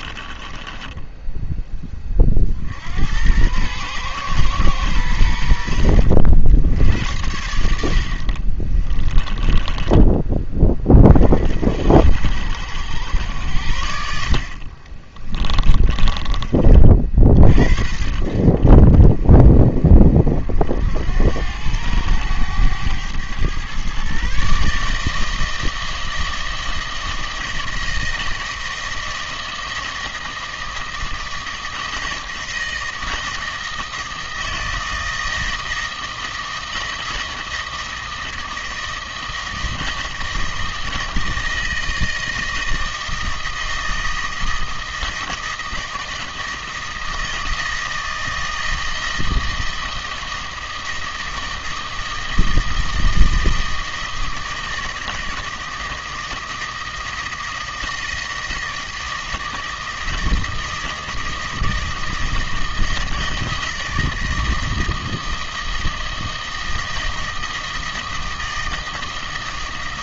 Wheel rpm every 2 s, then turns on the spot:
20, 60, 120, 80, 40, 30, 90, 40, 30, 60, 60, 100, 150, 160, 160, 160, 160, 160, 160, 160, 160, 160, 160, 160, 160, 160, 160, 160, 160, 160, 160, 160, 160, 160, 160.
0-2 8-10